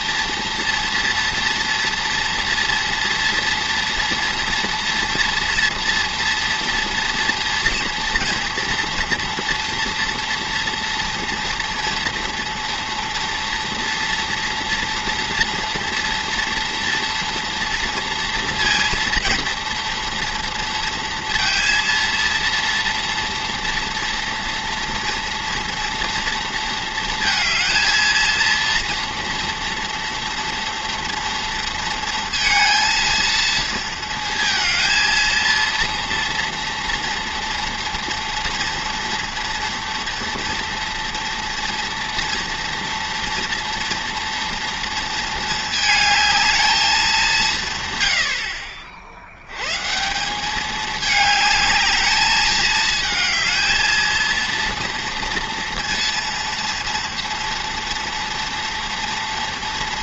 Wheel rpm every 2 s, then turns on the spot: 230, 230, 230, 240, 240, 230, 230, 230, 230, 230, 230, 230, 230, 230, 230, 230, 230, 230, 230, 240, 230, 230, 230, 190, 80, 210, 220, 240, 240, 230.
none